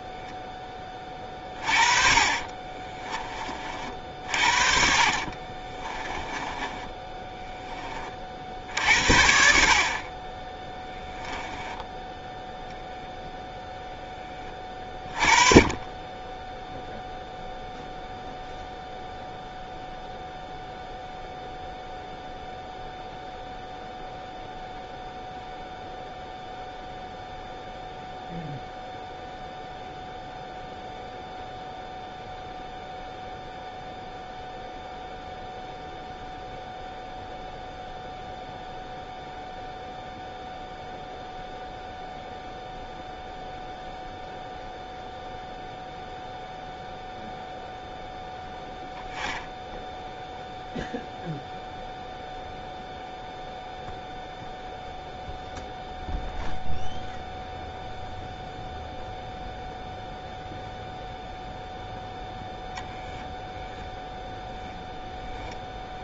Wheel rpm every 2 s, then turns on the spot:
20, 40, 60, 20, 60, 10, 0, 20, 0, 0, 0, 0, 0, 0, 0, 0, 0, 0, 0, 0, 0, 0, 0, 0, 0, 0, 0, 0, 0, 0, 0, 0, 0.
2-4 6-8